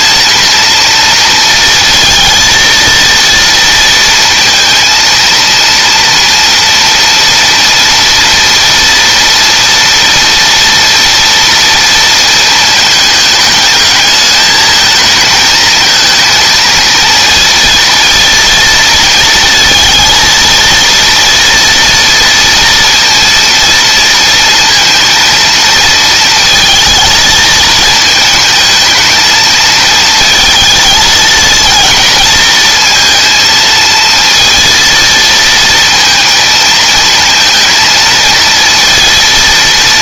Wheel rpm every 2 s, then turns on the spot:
230, 230, 230, 230, 230, 230, 210, 220, 230, 230, 230, 230, 230, 230, 220, 220, 230, 230, 230, 230.
none